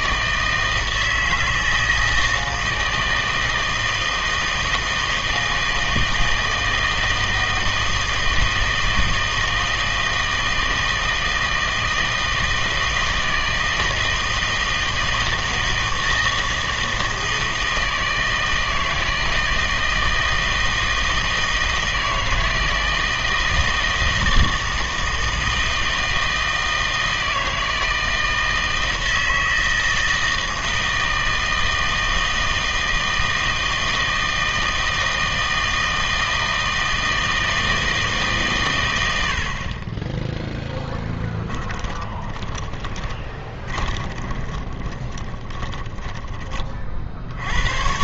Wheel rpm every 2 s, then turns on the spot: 160, 160, 160, 160, 160, 160, 160, 160, 160, 160, 160, 160, 160, 160, 160, 160, 160, 160, 160, 130, 10, 20, 20, 30.
42-46